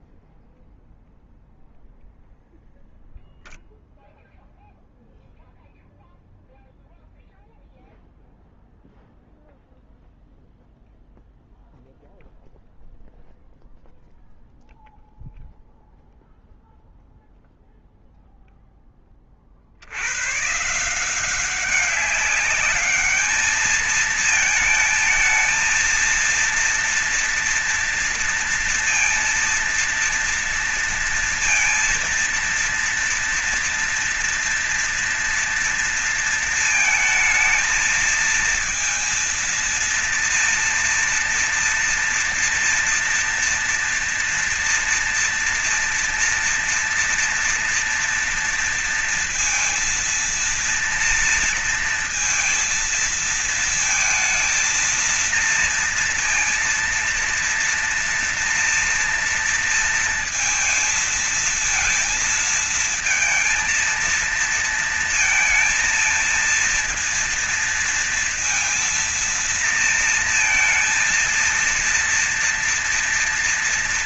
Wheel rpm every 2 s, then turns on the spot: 0, 0, 0, 0, 0, 0, 0, 0, 0, 0, 120, 200, 220, 230, 230, 230, 230, 230, 230, 220, 230, 230, 240, 230, 230, 230, 230, 230, 230, 230, 230, 230, 230, 230, 230, 230, 230.
none